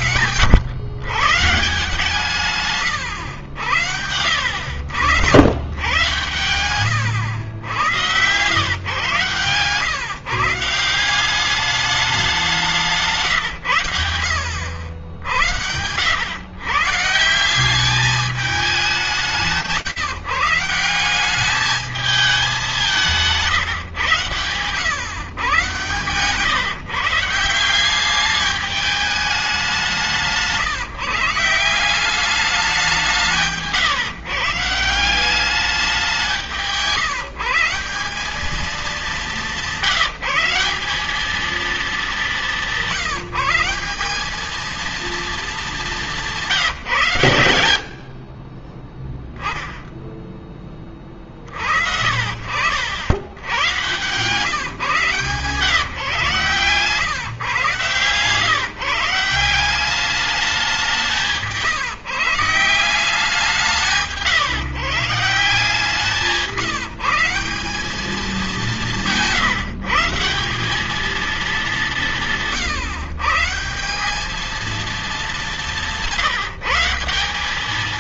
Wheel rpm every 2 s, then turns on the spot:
120, 120, 80, 100, 120, 170, 180, 90, 140, 200, 180, 190, 130, 150, 210, 150, 190, 180, 170, 210, 200, 180, 220, 140, 10, 40, 80, 140, 140, 160, 170, 170, 160, 170, 160, 210, 150, 210, 170.
none